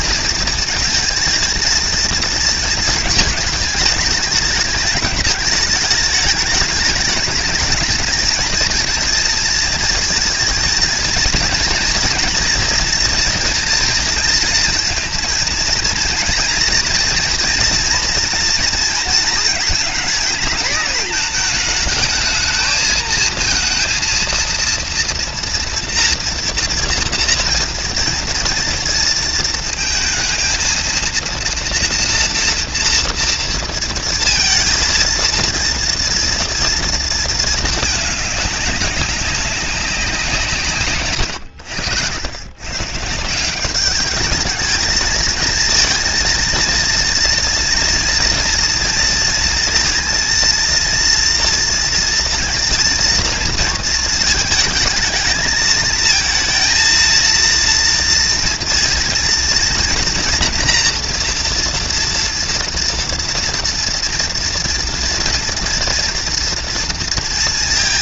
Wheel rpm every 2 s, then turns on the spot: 220, 220, 220, 210, 230, 230, 230, 230, 230, 230, 220, 220, 230, 230, 230, 230, 230, 230, 230, 200, 150, 140, 220, 230, 230, 230, 230, 220, 230, 230, 240, 230, 240, 230.
none